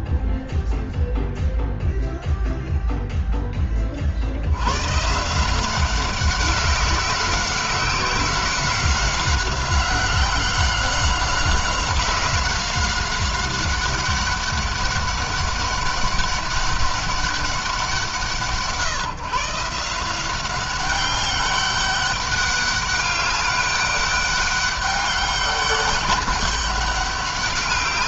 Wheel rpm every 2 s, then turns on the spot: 0, 0, 90, 190, 190, 190, 190, 200, 200, 160, 190, 200, 200, 200.
none